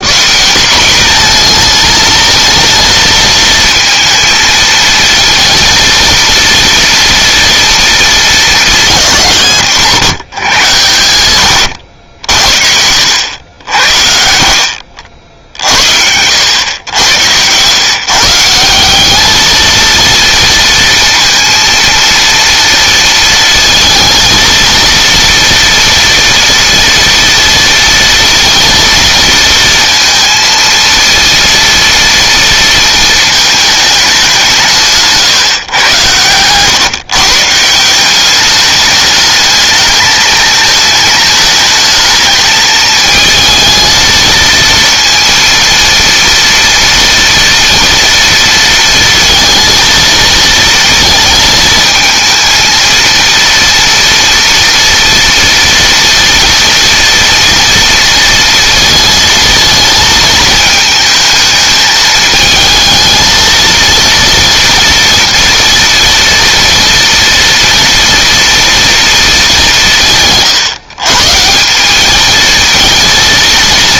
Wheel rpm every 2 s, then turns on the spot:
210, 230, 220, 230, 170, 110, 70, 70, 100, 190, 230, 230, 230, 230, 230, 230, 230, 140, 140, 210, 220, 220, 230, 230, 230, 230, 230, 230, 230, 220, 220, 220, 240, 230, 230, 130, 230.
34-36